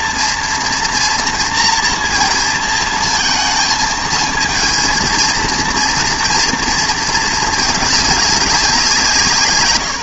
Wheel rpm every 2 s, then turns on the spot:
230, 220, 230, 230, 190.
none